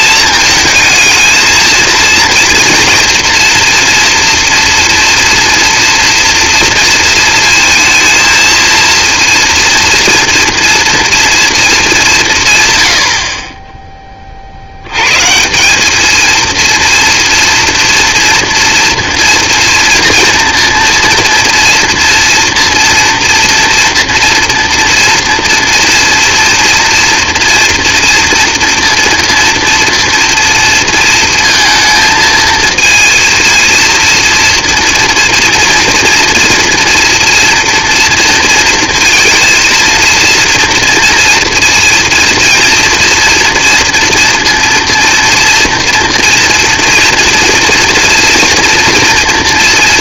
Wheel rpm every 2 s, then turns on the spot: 220, 230, 230, 230, 230, 230, 110, 70, 230, 230, 230, 240, 240, 240, 240, 230, 220, 230, 230, 230, 230, 230, 230, 230, 240.
none